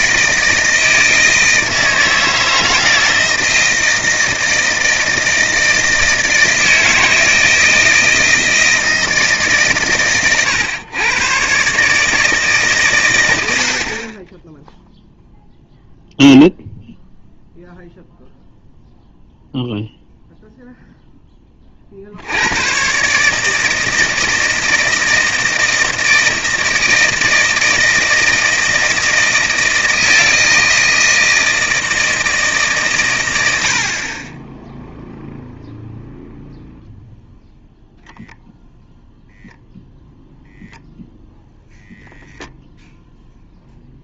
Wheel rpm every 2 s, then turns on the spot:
160, 160, 160, 160, 160, 120, 140, 10, 0, 0, 0, 110, 160, 160, 160, 160, 150, 10, 0, 0, 0, 0.
none